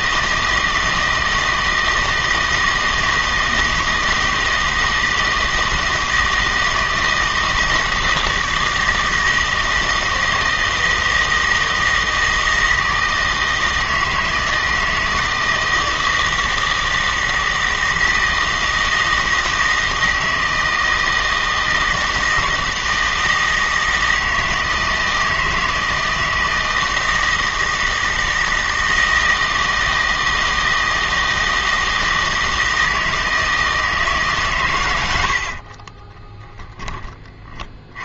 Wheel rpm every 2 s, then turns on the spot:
160, 160, 160, 160, 160, 160, 160, 160, 160, 160, 160, 160, 160, 160, 160, 160, 160, 130, 10.
none